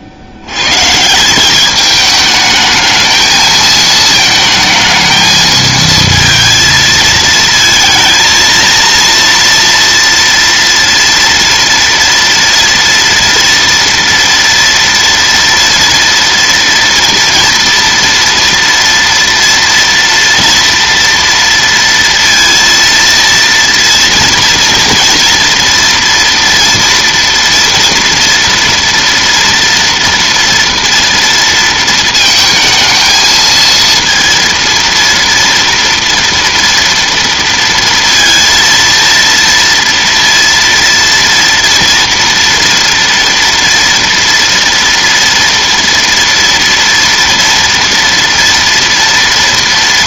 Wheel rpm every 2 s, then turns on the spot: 110, 210, 220, 220, 230, 230, 230, 230, 230, 230, 230, 230, 230, 230, 240, 230, 220, 230, 240, 230, 230, 230, 230, 230, 230.
none